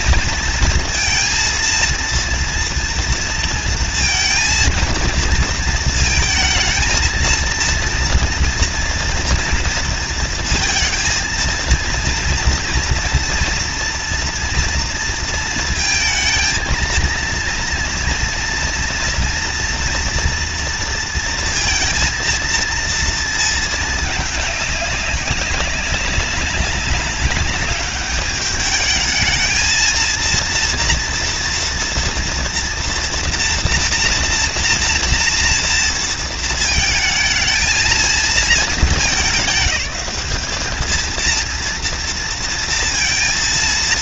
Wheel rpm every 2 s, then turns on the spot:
230, 230, 230, 230, 230, 230, 230, 230, 230, 230, 230, 230, 200, 190, 210, 230, 240, 230, 220, 210, 220, 230.
none